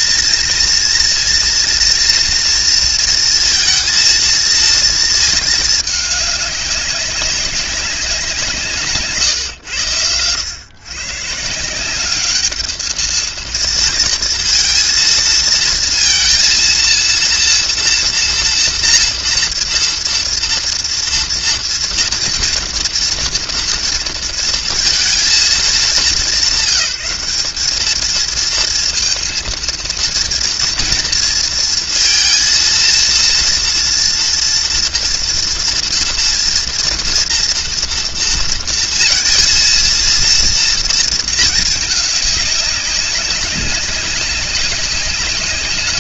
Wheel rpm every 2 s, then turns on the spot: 230, 230, 230, 200, 160, 110, 210, 230, 230, 230, 230, 230, 230, 190, 220, 240, 230, 240, 240, 230, 230, 200, 200.
none